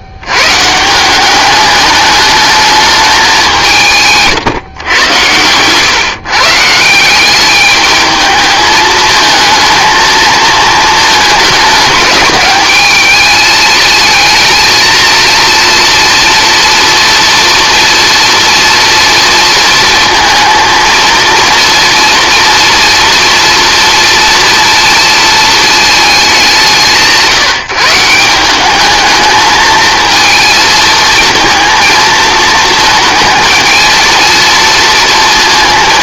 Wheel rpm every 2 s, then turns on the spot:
150, 210, 120, 170, 220, 220, 210, 230, 230, 230, 230, 240, 230, 160, 200, 220, 230, 230.
none